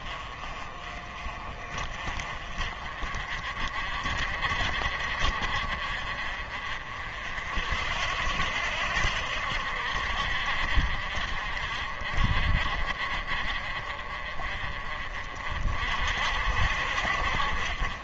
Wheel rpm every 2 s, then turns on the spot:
40, 40, 50, 50, 70, 50, 40, 40, 60.
none